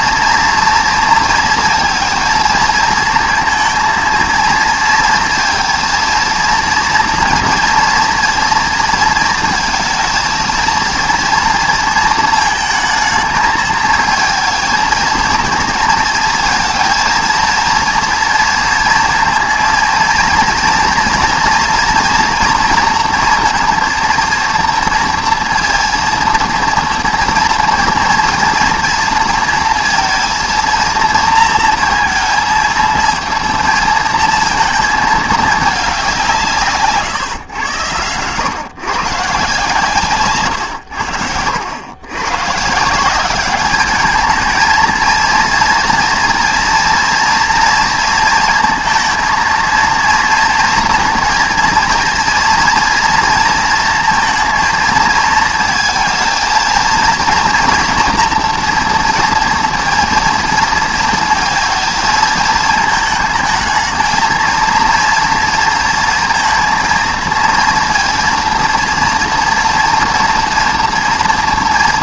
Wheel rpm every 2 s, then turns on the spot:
230, 230, 230, 230, 230, 230, 220, 220, 230, 230, 230, 230, 230, 230, 230, 230, 230, 220, 160, 130, 110, 160, 220, 230, 230, 230, 230, 230, 230, 230, 230, 220, 230, 230, 230, 230.
none